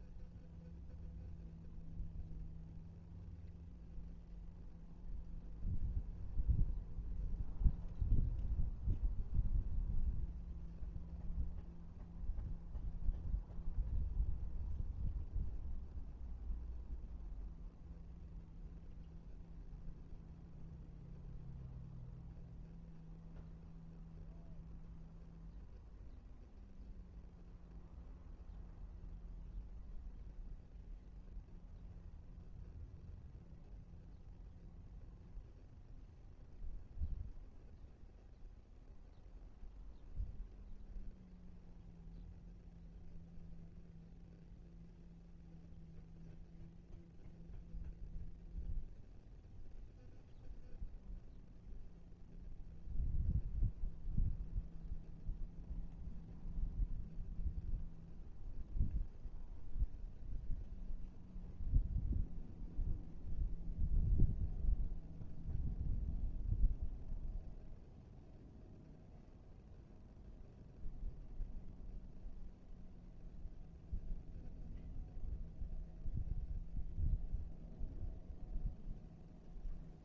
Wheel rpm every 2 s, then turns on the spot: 0, 0, 0, 0, 0, 0, 0, 0, 0, 0, 0, 0, 0, 0, 0, 0, 0, 0, 0, 0, 0, 0, 0, 0, 0, 0, 0, 0, 0, 0, 0, 0, 0, 0, 0, 0, 0, 0, 0, 0.
none